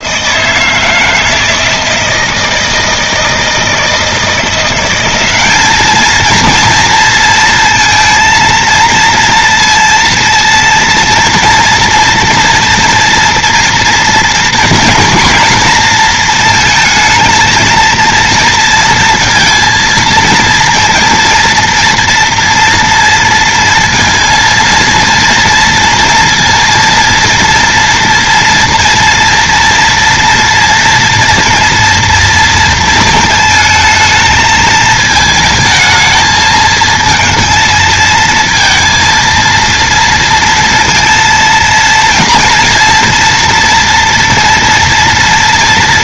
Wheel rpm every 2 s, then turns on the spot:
160, 160, 180, 230, 230, 230, 230, 230, 220, 230, 230, 230, 230, 230, 230, 230, 230, 220, 220, 230, 230, 230, 230.
none